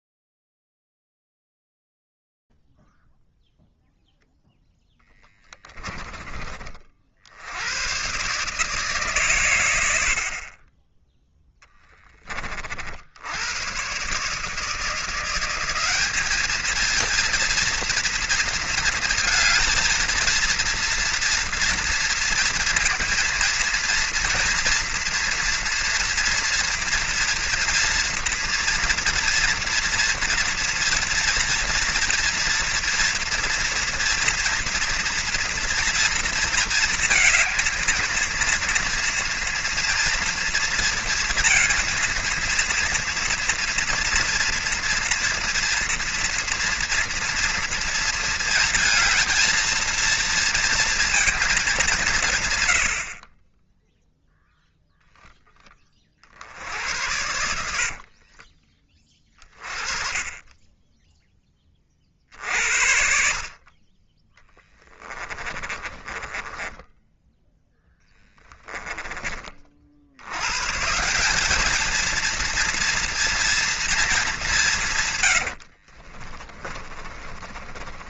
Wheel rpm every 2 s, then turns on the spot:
0, 0, 0, 30, 130, 60, 40, 160, 210, 230, 230, 230, 230, 230, 230, 240, 230, 230, 230, 230, 230, 230, 240, 230, 230, 230, 80, 0, 70, 20, 10, 60, 10, 10, 10, 150, 230, 150, 30.
64-70 76-78